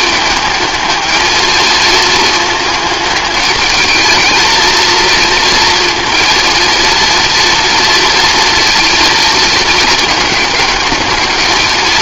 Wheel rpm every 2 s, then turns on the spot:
220, 220, 230, 230, 230, 210.
none